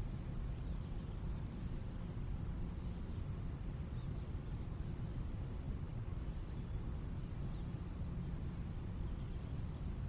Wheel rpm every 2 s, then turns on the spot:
0, 0, 0, 0, 0.
none